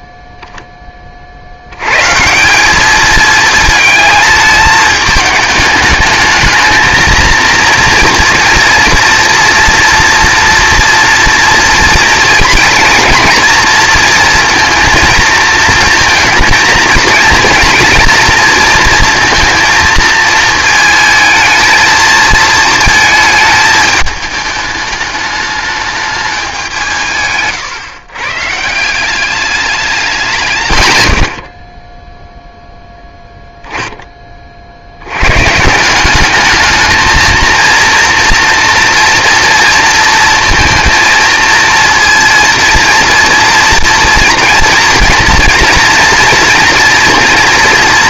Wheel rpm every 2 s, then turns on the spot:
0, 190, 220, 220, 240, 230, 230, 230, 230, 230, 230, 230, 210, 190, 150, 150, 0, 40, 210, 230, 230, 230, 240, 240.
none